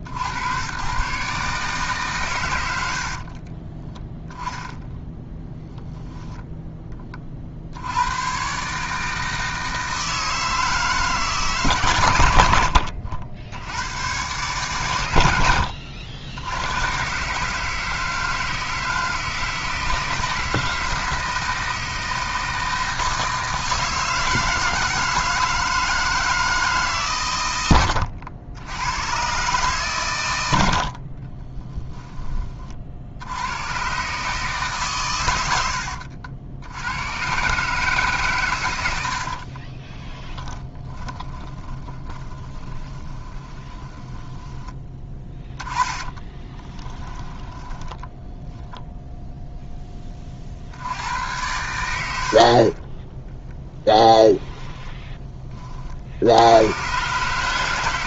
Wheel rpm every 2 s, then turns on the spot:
100, 120, 10, 10, 140, 160, 90, 130, 90, 160, 160, 160, 160, 160, 90, 90, 30, 140, 80, 130, 10, 20, 20, 20, 0, 60, 40, 10, 90.
4-6 40-44 46-48